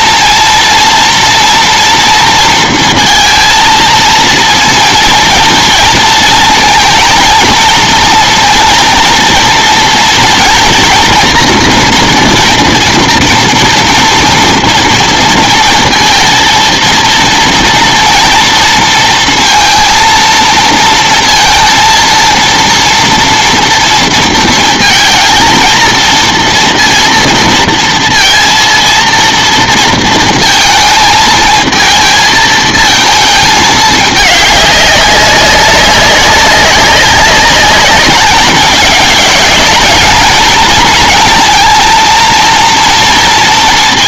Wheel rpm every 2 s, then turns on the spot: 230, 230, 230, 220, 230, 230, 230, 230, 230, 230, 230, 230, 230, 240, 230, 230, 220, 200, 200, 200, 230, 230.
none